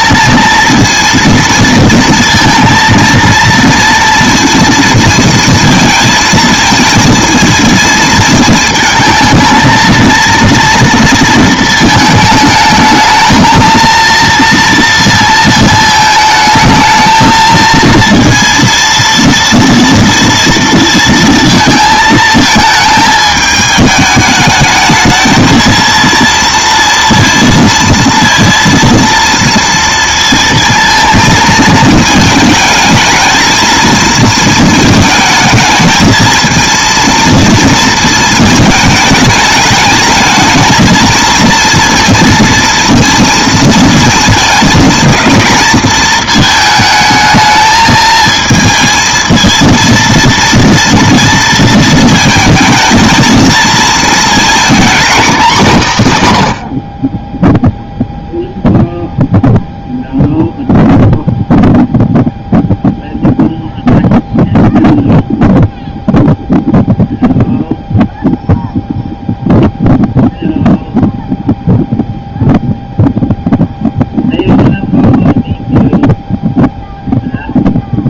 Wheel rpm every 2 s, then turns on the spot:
230, 230, 230, 220, 220, 230, 220, 230, 220, 230, 230, 220, 220, 230, 230, 230, 220, 220, 230, 220, 220, 230, 220, 220, 220, 230, 220, 230, 70, 0, 0, 0, 0, 0, 0, 0, 0, 0, 0.
none